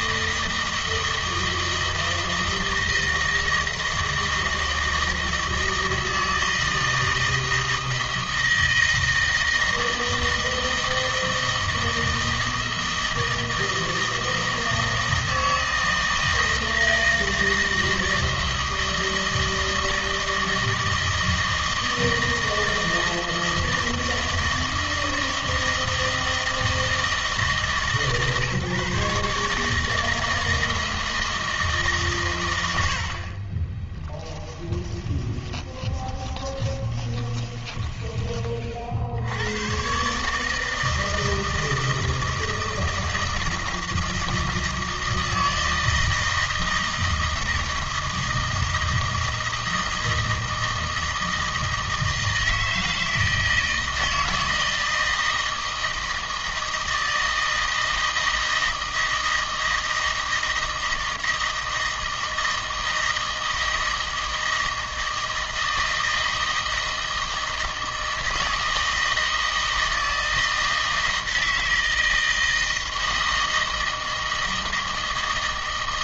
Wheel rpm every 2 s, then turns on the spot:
160, 160, 160, 160, 160, 160, 160, 160, 160, 160, 160, 160, 160, 160, 140, 160, 100, 10, 20, 30, 150, 160, 160, 160, 160, 160, 160, 160, 160, 160, 160, 160, 160, 160, 160, 160, 160, 160.
34-38